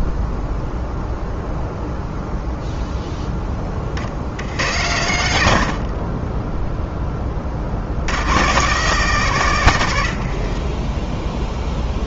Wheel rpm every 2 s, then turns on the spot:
0, 0, 80, 10, 140, 40.
10-12